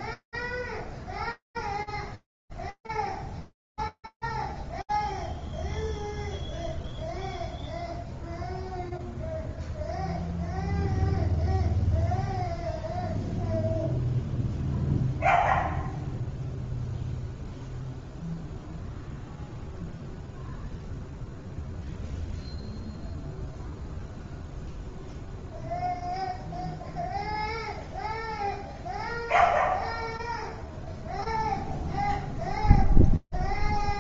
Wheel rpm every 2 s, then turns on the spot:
0, 0, 0, 0, 0, 0, 0, 0, 0, 0, 0, 0, 0, 0, 0, 0, 0.
none